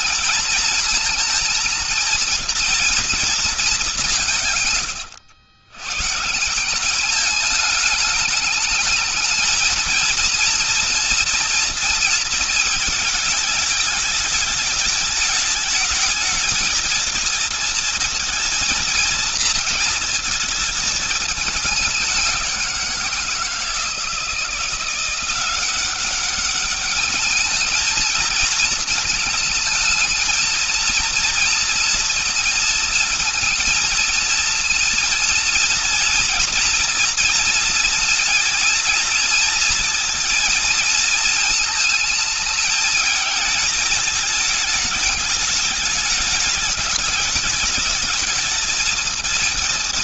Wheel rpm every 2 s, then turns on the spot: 220, 230, 120, 200, 220, 230, 220, 210, 230, 230, 210, 170, 180, 210, 220, 230, 230, 230, 230, 230, 220, 220, 210, 210, 220.
none